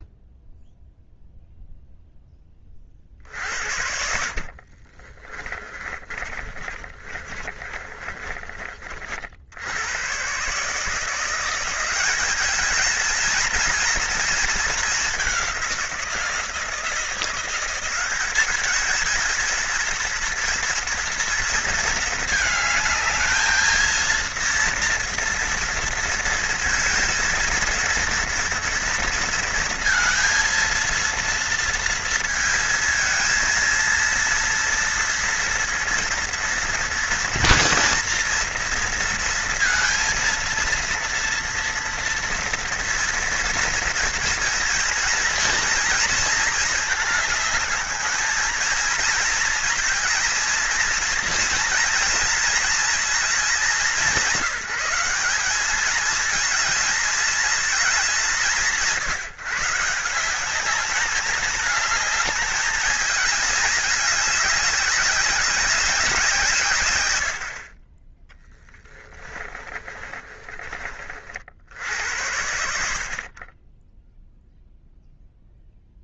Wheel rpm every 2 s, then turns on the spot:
0, 30, 50, 30, 40, 150, 210, 210, 170, 210, 240, 220, 230, 230, 230, 230, 230, 230, 240, 230, 230, 230, 220, 220, 220, 230, 230, 200, 220, 160, 200, 220, 200, 120, 10, 30, 80, 0.
4-8 68-70